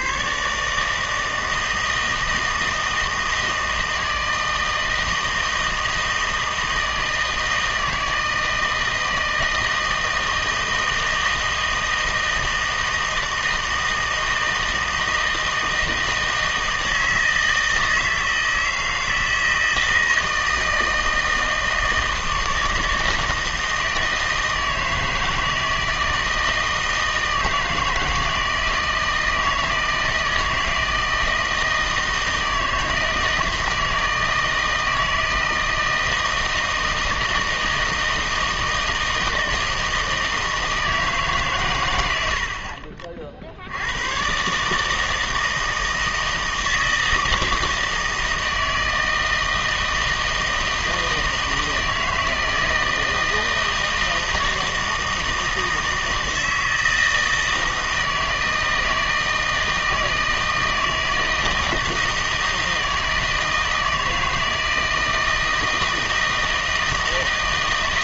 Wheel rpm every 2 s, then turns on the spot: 150, 160, 160, 160, 160, 160, 160, 160, 160, 160, 160, 160, 160, 160, 160, 160, 160, 160, 160, 160, 160, 50, 150, 160, 160, 160, 160, 160, 160, 160, 160, 160, 160, 160.
none